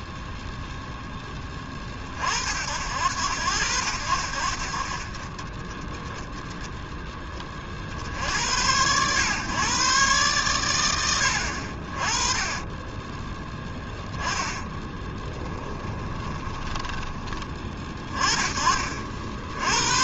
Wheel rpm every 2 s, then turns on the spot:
0, 60, 50, 0, 90, 110, 20, 10, 20, 40.
12-18